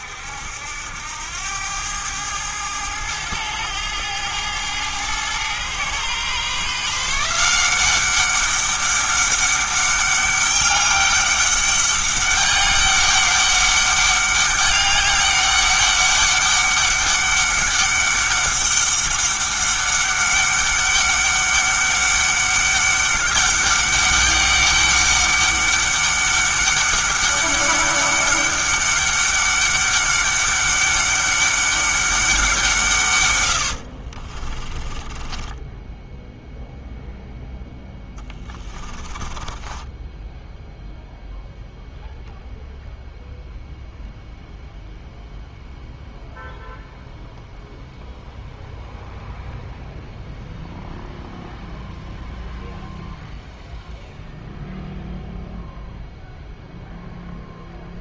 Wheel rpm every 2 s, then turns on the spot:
80, 110, 110, 150, 200, 200, 200, 200, 200, 200, 200, 200, 200, 200, 200, 200, 170, 30, 0, 20, 0, 0, 0, 0, 0, 0, 0, 0, 0.
34-36 38-40